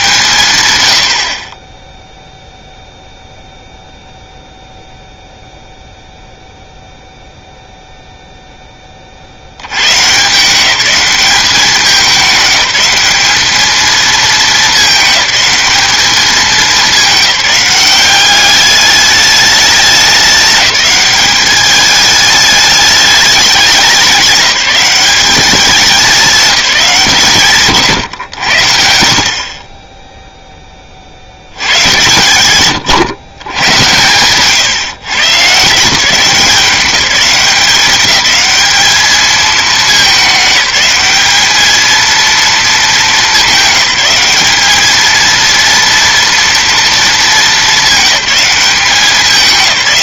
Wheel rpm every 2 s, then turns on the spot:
150, 0, 0, 0, 0, 160, 200, 220, 210, 200, 200, 210, 190, 200, 110, 0, 110, 120, 180, 210, 210, 230, 210, 230, 200.
none